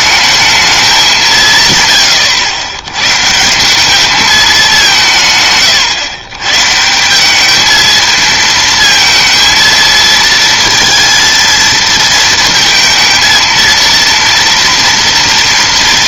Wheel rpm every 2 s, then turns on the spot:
220, 110, 190, 140, 230, 230, 230, 230.
none